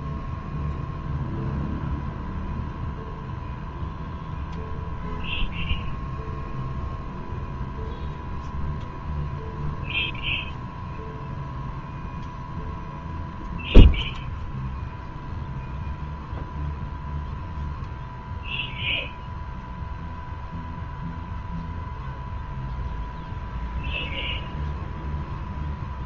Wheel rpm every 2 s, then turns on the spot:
0, 0, 0, 0, 0, 0, 0, 0, 0, 0, 0, 0, 0.
none